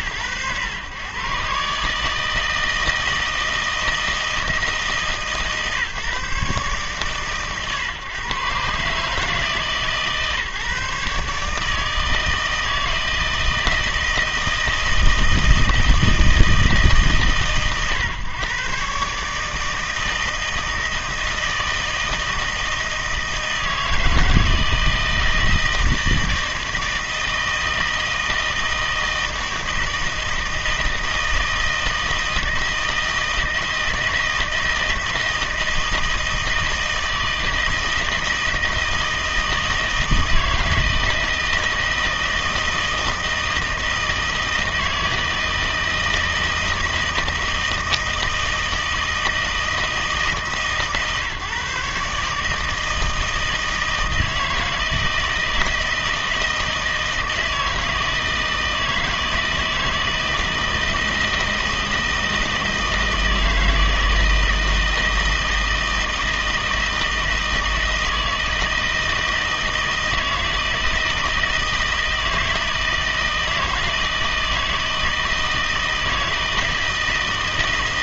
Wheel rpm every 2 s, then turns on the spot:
120, 160, 160, 140, 130, 150, 160, 160, 160, 120, 160, 160, 160, 160, 160, 160, 160, 160, 160, 160, 160, 160, 160, 160, 160, 150, 160, 160, 160, 160, 160, 160, 160, 160, 160, 160, 160, 160, 160.
none